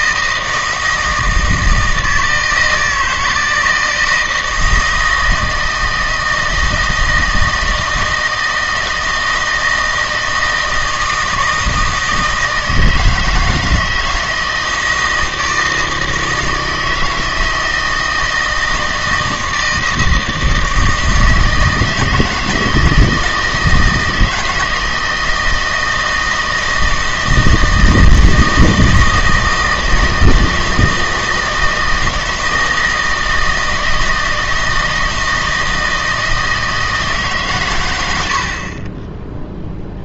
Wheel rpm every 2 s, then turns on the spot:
160, 160, 160, 160, 160, 160, 160, 160, 160, 160, 160, 160, 160, 160, 160, 160, 160, 160, 160, 30.
none